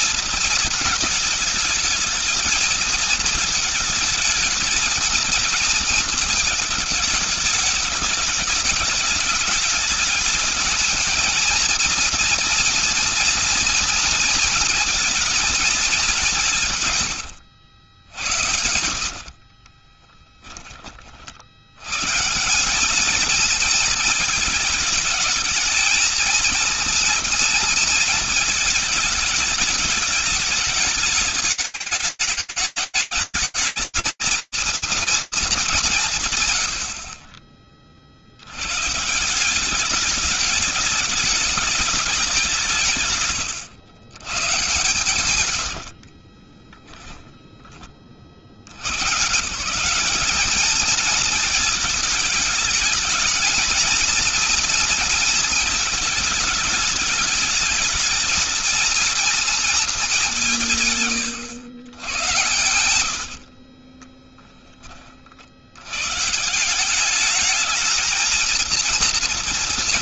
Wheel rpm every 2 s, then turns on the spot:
220, 220, 220, 220, 210, 220, 230, 220, 170, 80, 30, 170, 220, 230, 220, 220, 210, 230, 130, 80, 210, 180, 130, 20, 120, 220, 210, 230, 210, 230, 150, 80, 40, 200, 230.
18-20 46-48 60-64